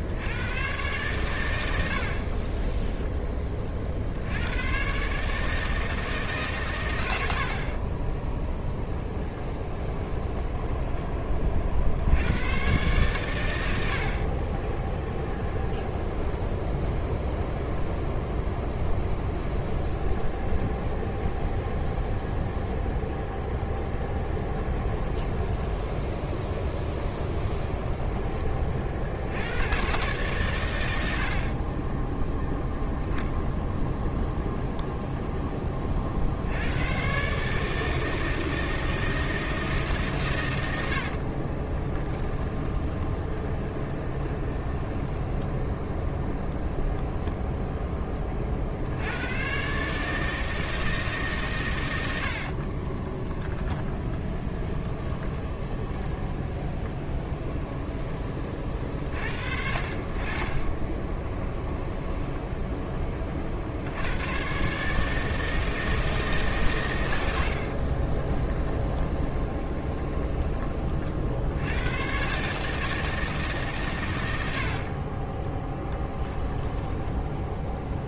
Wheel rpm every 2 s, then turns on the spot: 120, 10, 120, 120, 10, 20, 120, 20, 0, 0, 0, 0, 10, 10, 50, 90, 0, 0, 110, 160, 70, 10, 10, 0, 70, 160, 30, 20, 20, 50, 20, 20, 140, 110, 10, 40, 160, 50, 10.
2-4 8-10 14-16 24-26 40-46 52-58 60-62 68-70 76-78